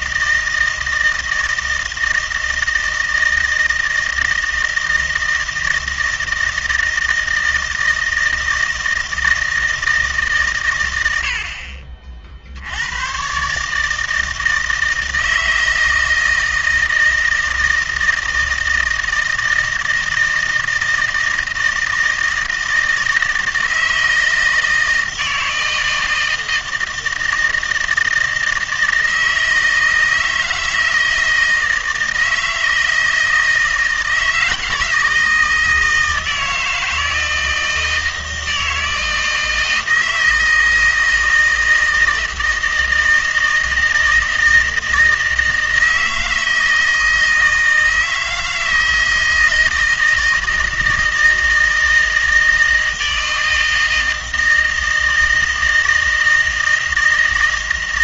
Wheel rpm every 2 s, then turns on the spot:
160, 160, 160, 160, 160, 120, 90, 160, 160, 160, 160, 160, 160, 160, 160, 160, 160, 160, 160, 160, 160, 160, 160, 160, 160, 160, 160, 160, 160.
none